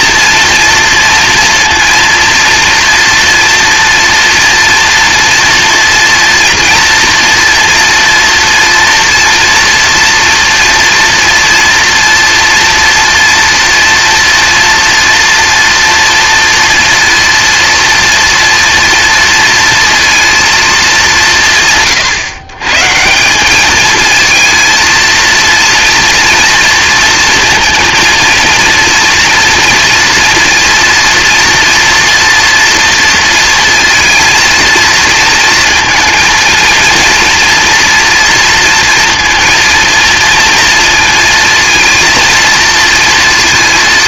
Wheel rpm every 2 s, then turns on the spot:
230, 230, 230, 230, 230, 230, 230, 230, 230, 230, 200, 150, 230, 230, 230, 230, 230, 220, 230, 230, 230, 230.
none